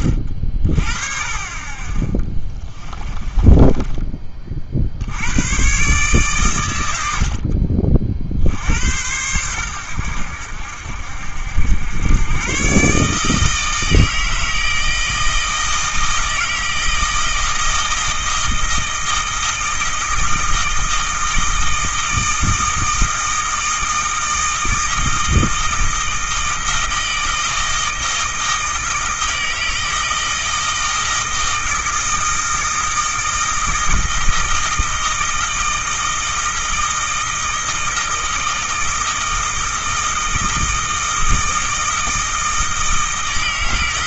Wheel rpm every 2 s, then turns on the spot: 40, 20, 60, 110, 70, 70, 130, 160, 160, 160, 160, 160, 160, 160, 160, 160, 160, 160, 160, 160, 160, 160.
2-4